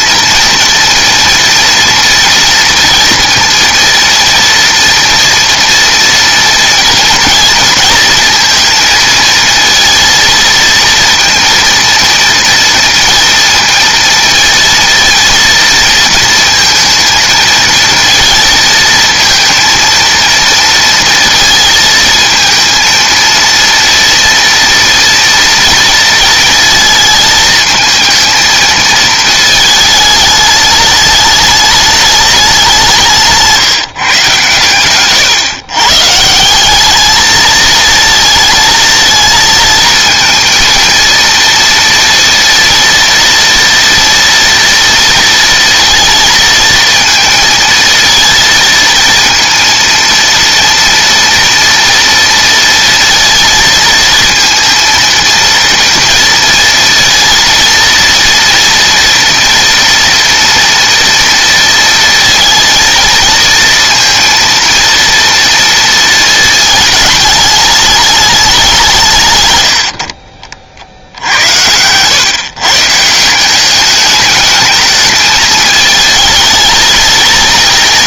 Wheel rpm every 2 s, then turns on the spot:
230, 230, 230, 230, 230, 230, 230, 230, 230, 220, 230, 220, 230, 230, 220, 210, 200, 140, 160, 230, 230, 230, 230, 230, 230, 230, 230, 230, 230, 230, 230, 230, 230, 220, 200, 50, 130, 220, 220.
70-72